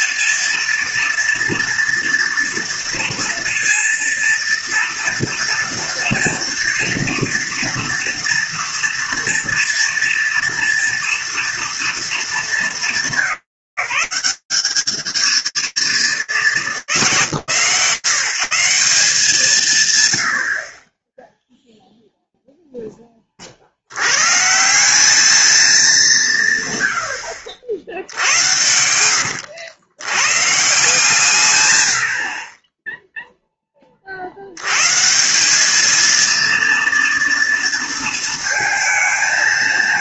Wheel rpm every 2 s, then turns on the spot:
230, 230, 230, 240, 240, 240, 200, 160, 130, 140, 0, 40, 220, 80, 80, 130, 10, 180, 230, 220.
28-30